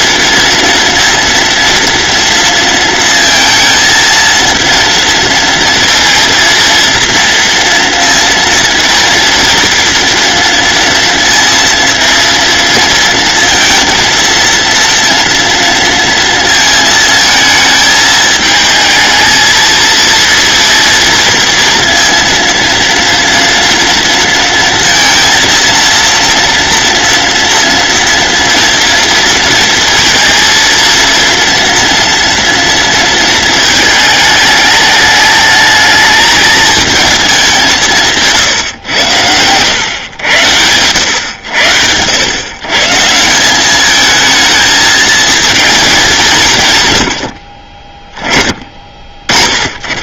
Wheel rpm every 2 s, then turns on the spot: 230, 230, 230, 230, 230, 230, 230, 230, 220, 220, 230, 230, 230, 230, 230, 230, 230, 210, 220, 100, 100, 150, 220, 100, 30.
none